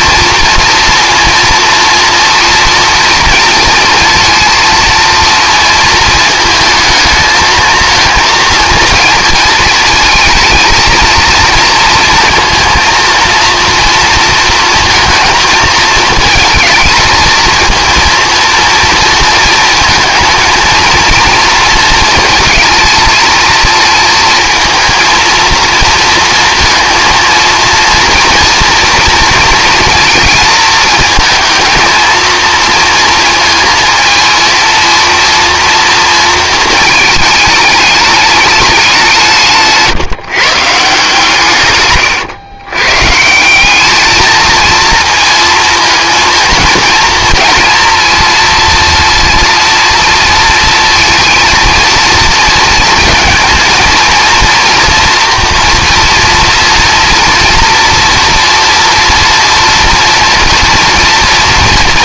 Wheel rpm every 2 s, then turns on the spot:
230, 230, 220, 220, 230, 220, 230, 230, 220, 230, 230, 230, 230, 230, 230, 220, 230, 230, 220, 200, 150, 120, 230, 230, 230, 230, 220, 230, 230, 230, 230.
none